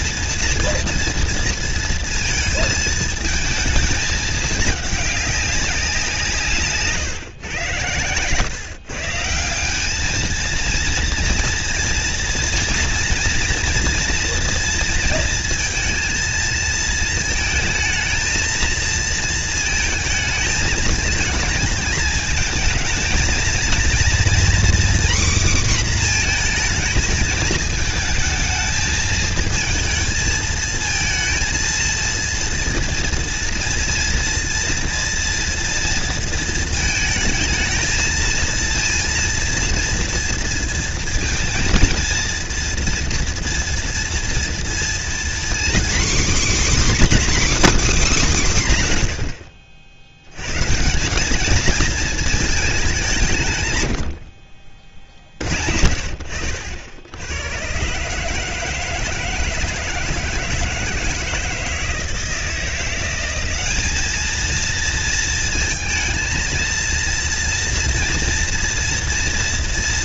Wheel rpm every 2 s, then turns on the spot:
230, 220, 210, 160, 120, 220, 230, 230, 230, 230, 220, 220, 240, 230, 220, 220, 230, 230, 230, 230, 230, 230, 240, 280, 190, 110, 220, 50, 80, 150, 160, 170, 220, 230, 240.
54-56